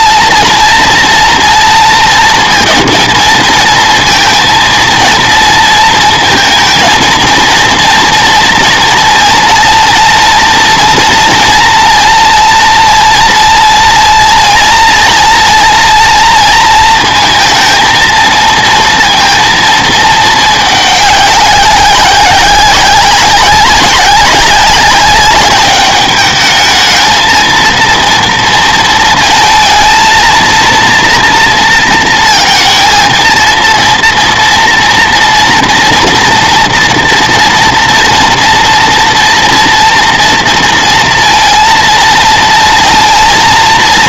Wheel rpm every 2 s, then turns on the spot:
230, 230, 230, 230, 230, 230, 230, 230, 230, 230, 210, 190, 200, 220, 230, 230, 230, 230, 230, 230, 230, 230.
none